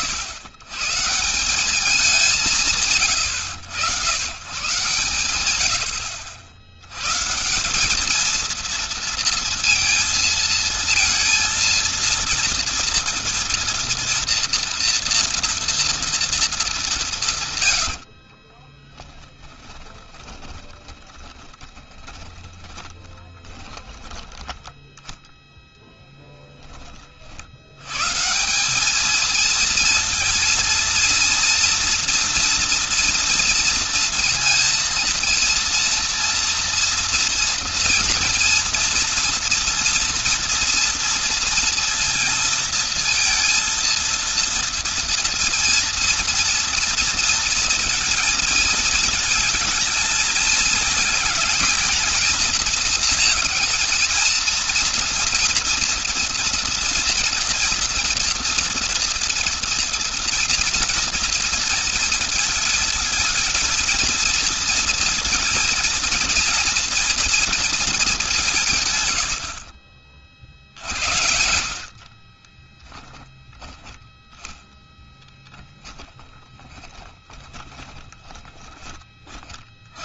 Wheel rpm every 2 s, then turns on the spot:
120, 100, 110, 100, 230, 230, 230, 230, 190, 20, 20, 20, 10, 10, 170, 230, 230, 230, 230, 230, 240, 230, 230, 230, 220, 220, 230, 230, 230, 230, 230, 230, 230, 240, 160, 60, 30, 10, 20, 20.
18-24 72-74 76-78